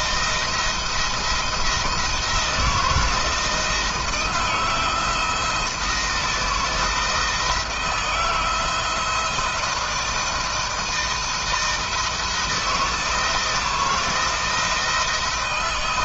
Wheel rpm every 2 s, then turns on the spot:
170, 160, 170, 160, 160, 170, 160, 170.
none